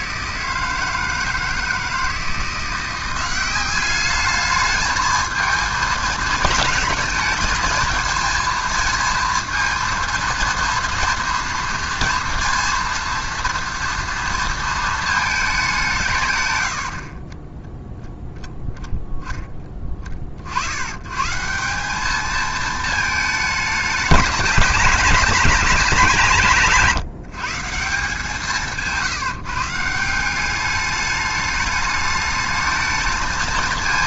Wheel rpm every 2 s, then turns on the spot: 160, 160, 210, 210, 230, 230, 230, 230, 120, 0, 50, 220, 210, 190, 170, 190, 220.
none